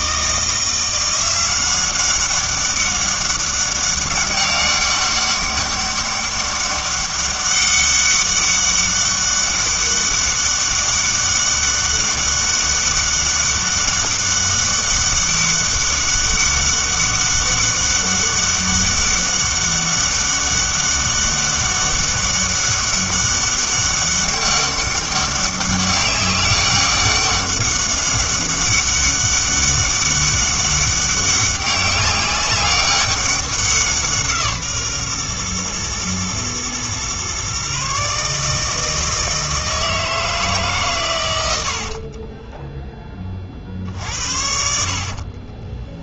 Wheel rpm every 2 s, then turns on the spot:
170, 200, 200, 200, 200, 200, 200, 200, 200, 200, 200, 200, 200, 200, 200, 200, 200, 150, 120, 160, 150, 10, 60.
42-44